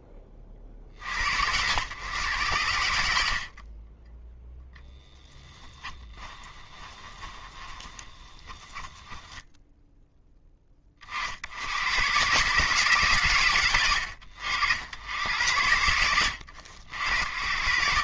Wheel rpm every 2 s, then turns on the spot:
60, 40, 0, 20, 10, 40, 140, 60, 90.
6-10